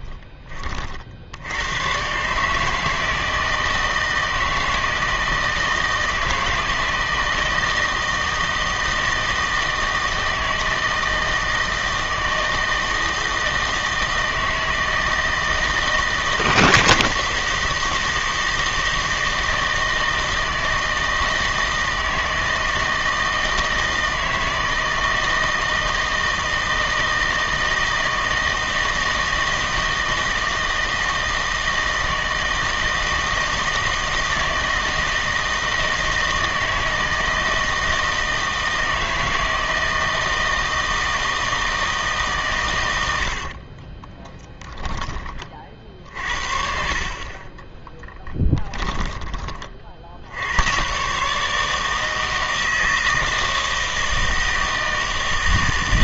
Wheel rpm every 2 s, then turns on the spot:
40, 160, 160, 160, 160, 160, 160, 160, 160, 160, 160, 160, 160, 160, 160, 160, 160, 160, 160, 160, 160, 110, 10, 50, 20, 110, 160, 160.
46-50